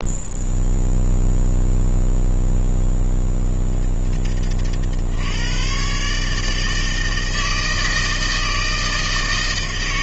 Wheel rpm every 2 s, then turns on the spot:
0, 0, 50, 160, 160.
none